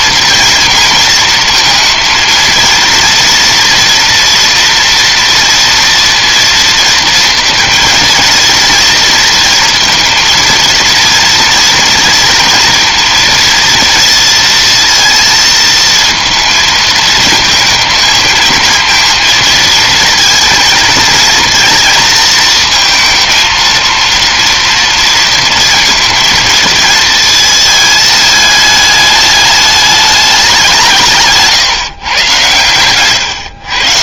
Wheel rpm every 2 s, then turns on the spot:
230, 230, 230, 230, 230, 230, 230, 230, 230, 230, 230, 220, 230, 230, 220, 200, 120.
none